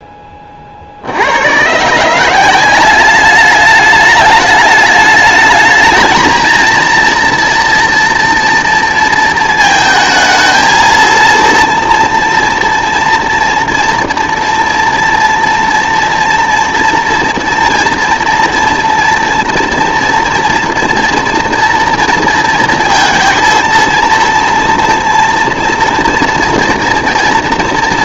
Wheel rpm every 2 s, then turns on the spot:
30, 180, 210, 230, 230, 220, 230, 230, 240, 240, 230, 230, 230, 230.
none